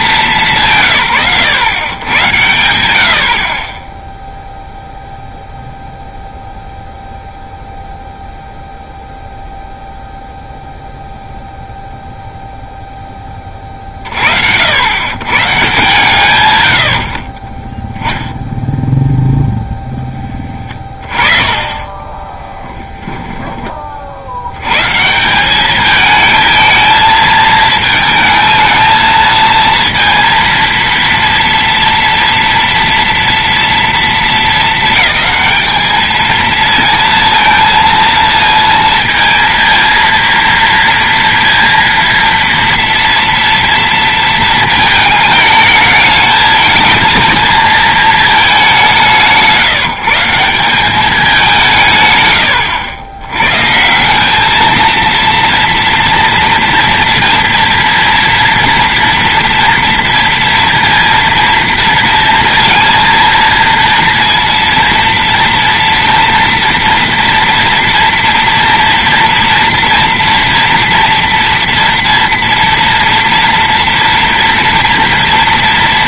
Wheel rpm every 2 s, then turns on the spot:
160, 90, 0, 0, 0, 0, 0, 80, 100, 0, 20, 10, 100, 220, 220, 230, 230, 220, 230, 230, 230, 230, 220, 220, 200, 180, 90, 210, 230, 230, 230, 230, 230, 230, 240, 230, 230, 230.
22-24